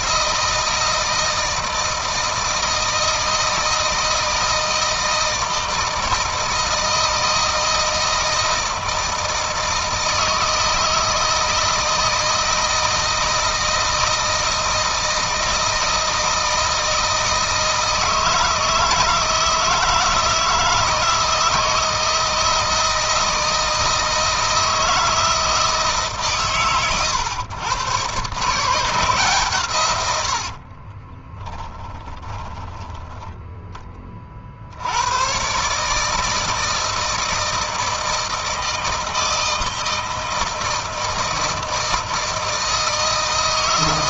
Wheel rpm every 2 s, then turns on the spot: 160, 160, 160, 160, 160, 160, 160, 160, 160, 160, 160, 160, 160, 120, 150, 40, 10, 90, 160, 160, 160, 160.
30-32